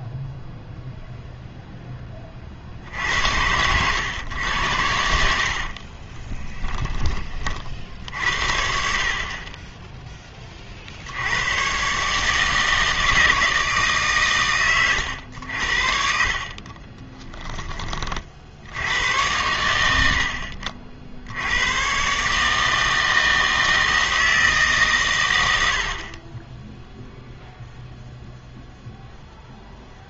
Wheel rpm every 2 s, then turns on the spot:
0, 50, 90, 20, 60, 30, 160, 110, 40, 60, 50, 150, 150, 10, 0.
6-8 16-18 26-28